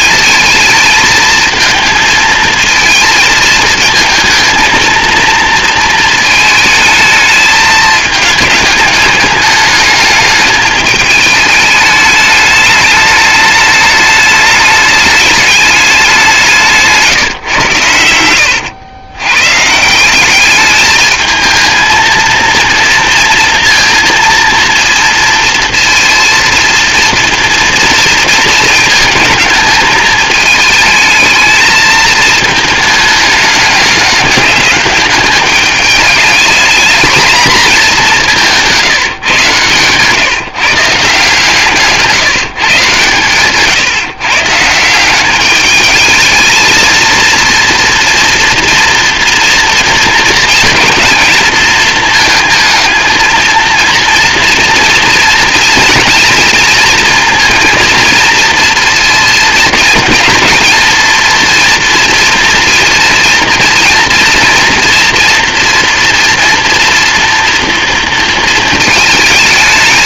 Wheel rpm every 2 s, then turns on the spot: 220, 220, 220, 220, 210, 210, 210, 210, 180, 100, 210, 230, 230, 230, 220, 220, 220, 200, 220, 170, 150, 150, 150, 220, 230, 220, 220, 230, 230, 230, 230, 230, 230, 230, 220.
none